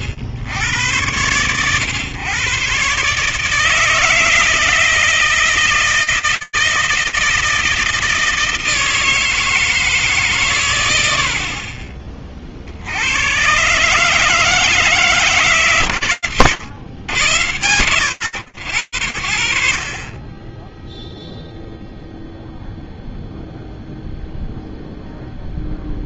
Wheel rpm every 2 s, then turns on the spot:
80, 130, 160, 170, 160, 120, 80, 160, 130, 60, 0, 0, 0.
none